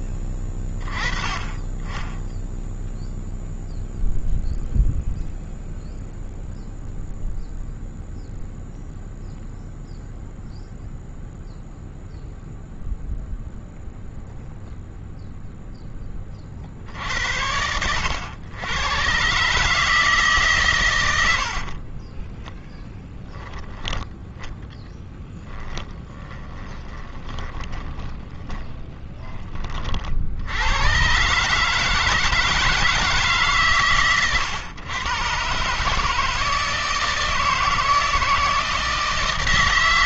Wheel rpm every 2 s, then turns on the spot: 30, 0, 0, 0, 0, 0, 0, 0, 50, 100, 140, 20, 10, 10, 50, 90, 160, 110, 160, 160.
22-30